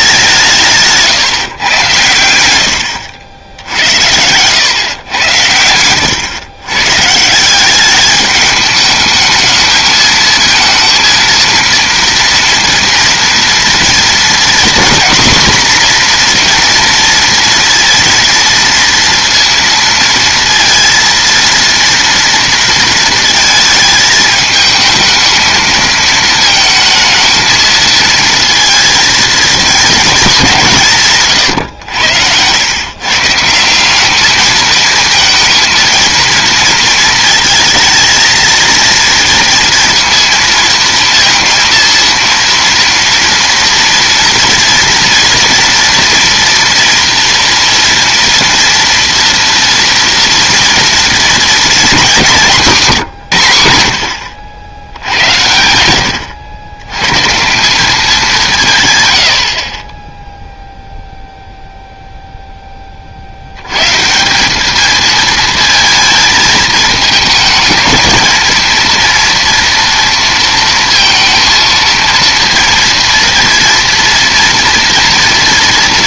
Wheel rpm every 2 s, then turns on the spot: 170, 90, 110, 130, 210, 230, 230, 240, 240, 230, 230, 230, 220, 220, 230, 180, 120, 220, 230, 230, 230, 230, 230, 230, 230, 230, 190, 80, 100, 170, 0, 10, 200, 210, 230, 230, 230, 230.
none